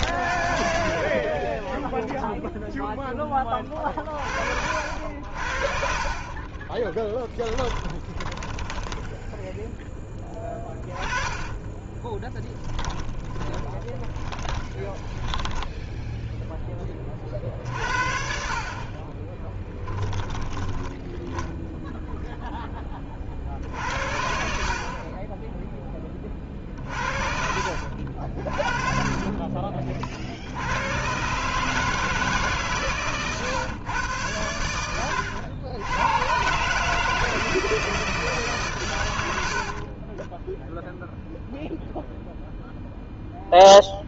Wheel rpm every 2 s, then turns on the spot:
40, 0, 70, 20, 10, 20, 30, 20, 20, 50, 20, 20, 50, 50, 30, 100, 140, 90, 150, 120, 0, 0.
6-16 18-20 28-30 34-36